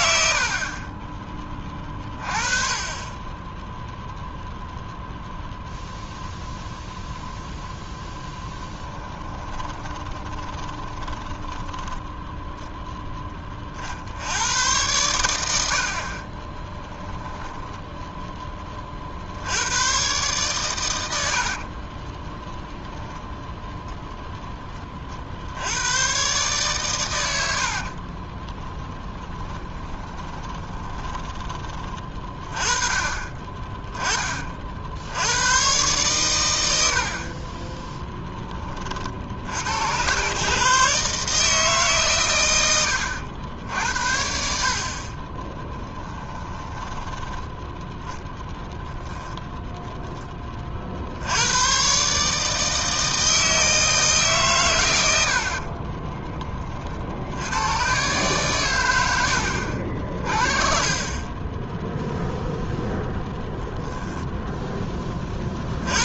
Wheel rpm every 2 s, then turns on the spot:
30, 10, 0, 0, 20, 10, 10, 100, 10, 40, 100, 0, 40, 110, 10, 20, 30, 60, 70, 40, 140, 100, 50, 10, 10, 40, 160, 110, 40, 100, 40, 10, 20.
8-12 30-32 36-38 46-48